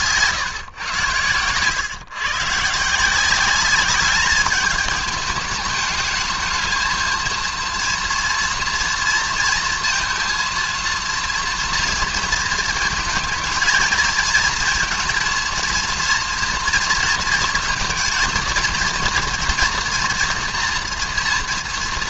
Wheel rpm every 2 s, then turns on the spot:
120, 150, 210, 220, 230, 230, 230, 230, 230, 230, 230.
none